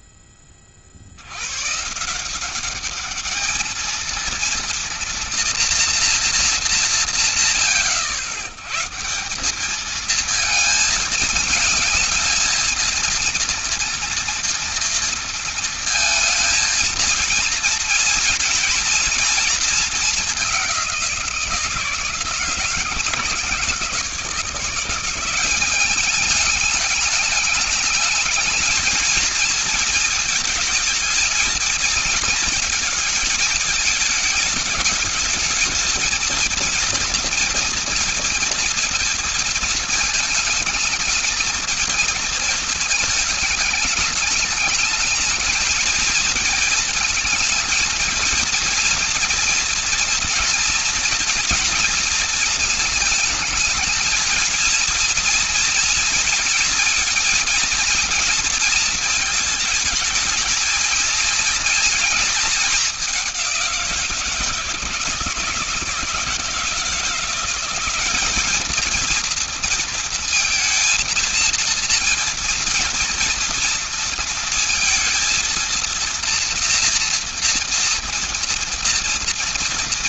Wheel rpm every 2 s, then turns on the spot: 90, 210, 240, 140, 180, 220, 230, 230, 220, 230, 170, 160, 180, 210, 230, 220, 220, 220, 230, 230, 220, 220, 210, 220, 230, 230, 220, 230, 230, 220, 220, 210, 160, 160, 220, 230, 230, 230, 230, 230.
none